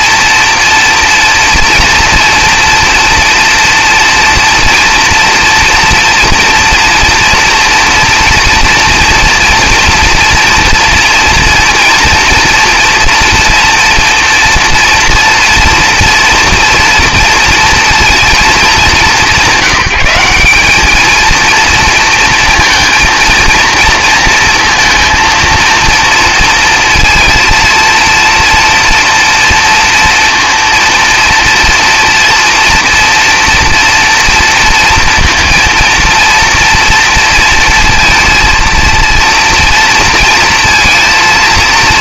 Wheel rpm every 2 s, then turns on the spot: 230, 240, 240, 230, 230, 230, 230, 230, 240, 210, 200, 230, 230, 230, 240, 230, 230, 230, 230, 230, 230.
none